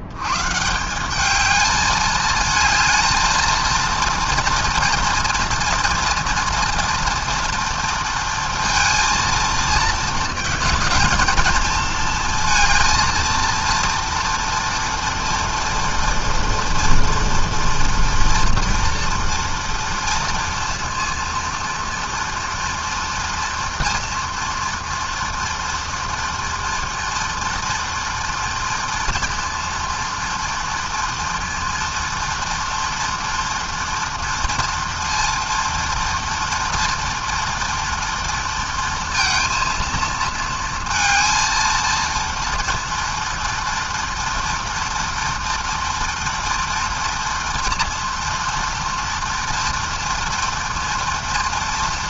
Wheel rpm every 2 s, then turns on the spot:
210, 220, 230, 230, 230, 220, 230, 230, 230, 230, 230, 240, 230, 230, 240, 230, 230, 230, 230, 230, 230, 230, 230, 230, 230, 230.
none